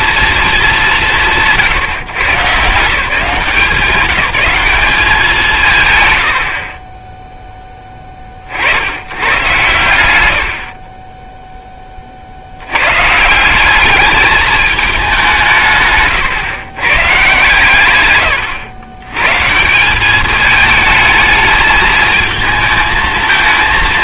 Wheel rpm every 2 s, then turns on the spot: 210, 160, 190, 10, 70, 50, 100, 210, 140, 110, 220, 220.
none